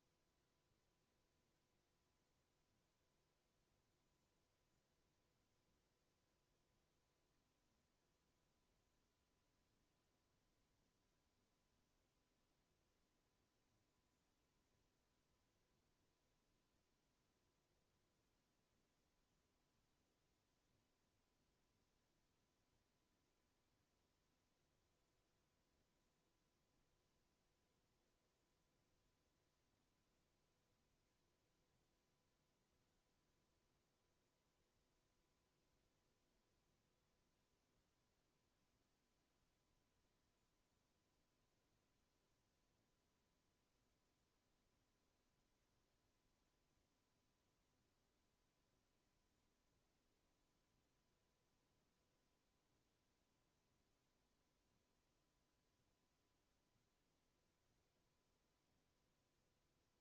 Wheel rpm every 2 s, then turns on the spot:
0, 0, 0, 0, 0, 0, 0, 0, 0, 0, 0, 0, 0, 0, 0, 0, 0, 0, 0, 0, 0, 0, 0, 0, 0, 0, 0, 0, 0, 0.
none